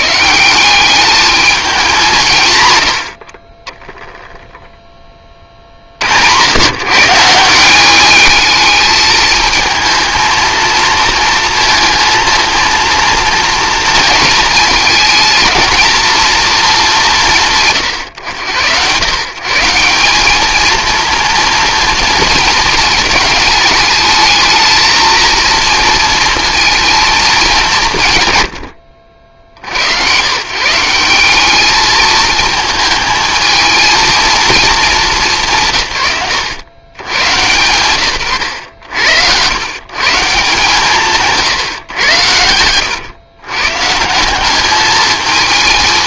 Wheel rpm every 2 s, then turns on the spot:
190, 110, 10, 120, 210, 230, 230, 220, 210, 120, 230, 220, 220, 230, 80, 160, 220, 220, 130, 90, 150, 110, 210.
38-40